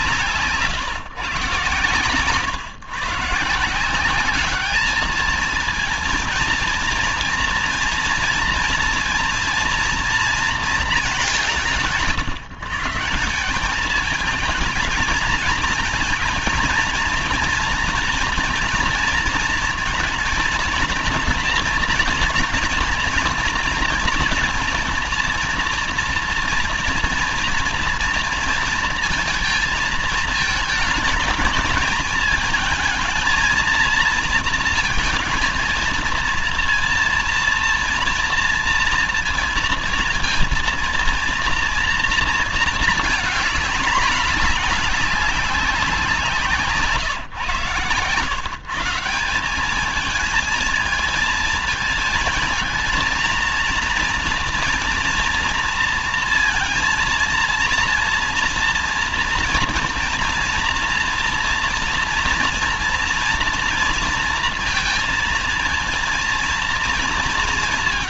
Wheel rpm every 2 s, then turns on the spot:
150, 140, 200, 230, 230, 230, 150, 220, 230, 230, 230, 230, 230, 230, 230, 220, 220, 230, 230, 240, 230, 230, 200, 150, 140, 220, 220, 230, 230, 230, 230, 240, 230, 230.
none